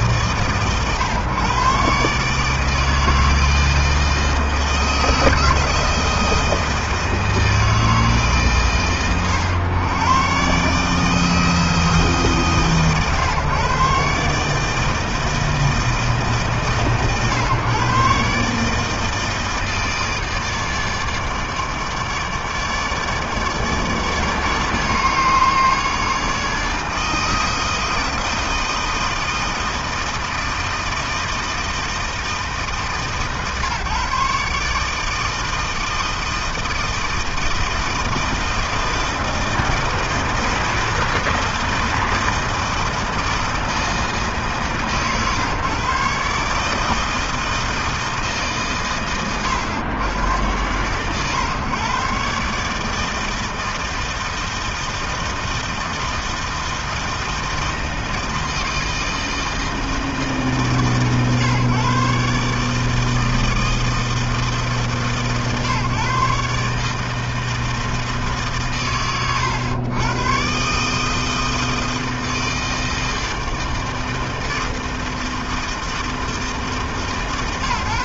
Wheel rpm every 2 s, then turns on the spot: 130, 160, 160, 160, 110, 160, 130, 160, 120, 160, 150, 150, 150, 160, 160, 160, 130, 160, 160, 160, 160, 160, 130, 160, 100, 130, 160, 160, 160, 160, 130, 160, 130, 160, 100, 160, 160, 160, 140.
none